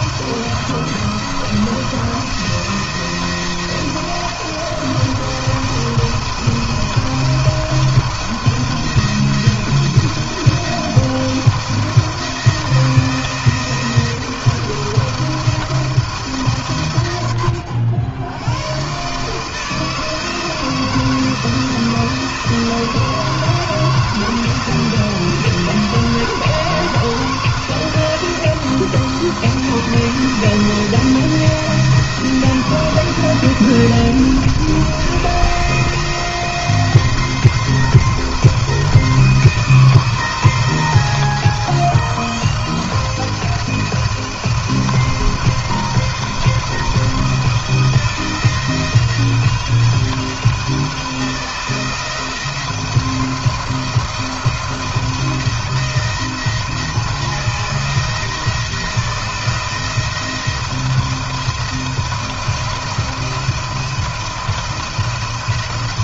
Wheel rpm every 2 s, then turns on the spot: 170, 170, 160, 170, 170, 170, 170, 170, 140, 130, 160, 160, 170, 160, 170, 170, 170, 170, 170, 160, 160, 160, 170, 170, 170, 170, 170, 170, 160, 170, 170, 170, 170.
none